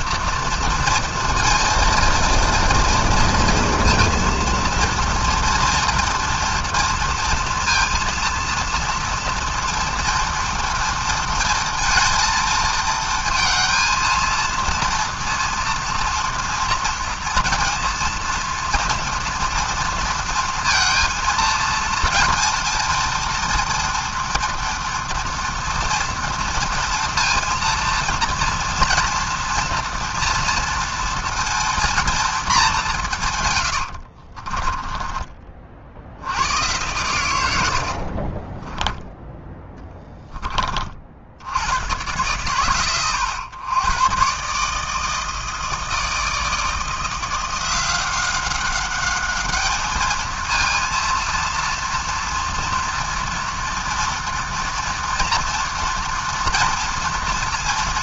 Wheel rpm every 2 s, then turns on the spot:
230, 230, 230, 230, 230, 230, 230, 230, 230, 230, 230, 230, 230, 230, 230, 230, 230, 70, 60, 70, 10, 100, 110, 160, 180, 220, 230, 240, 230.
34-36 38-42